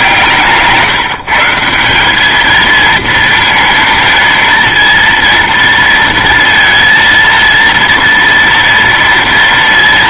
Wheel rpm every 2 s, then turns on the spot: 160, 220, 230, 230, 230.
0-2